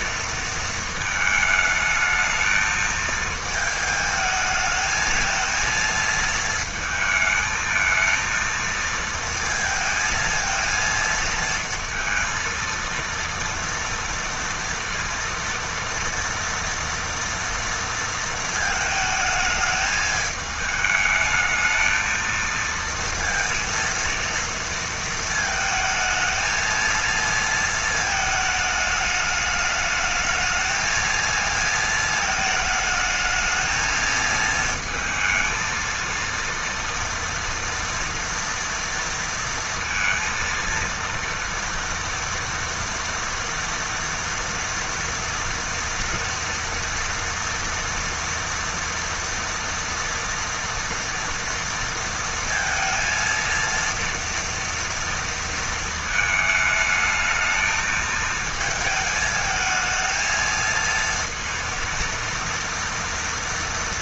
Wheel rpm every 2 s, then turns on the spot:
230, 220, 220, 220, 230, 220, 230, 230, 230, 220, 210, 230, 230, 220, 220, 220, 220, 220, 230, 230, 230, 230, 230, 230, 230, 230, 230, 230, 220, 220, 230, 230.
none